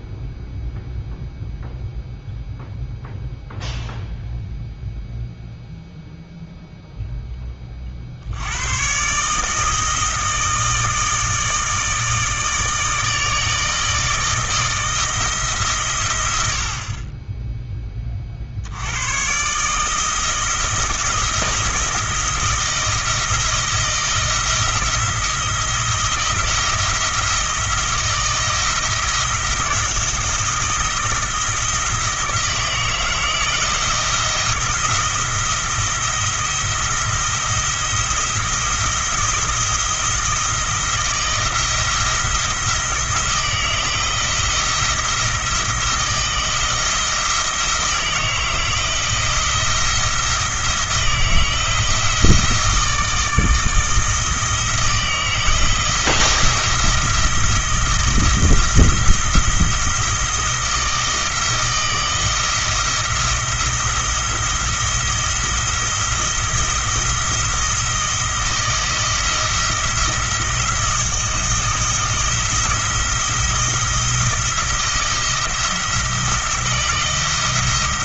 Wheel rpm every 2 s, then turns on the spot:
0, 0, 0, 0, 80, 160, 160, 160, 90, 50, 160, 170, 170, 170, 160, 170, 160, 170, 170, 170, 170, 170, 170, 170, 160, 170, 160, 160, 170, 170, 170, 160, 170, 170, 170, 170, 170, 170, 160.
none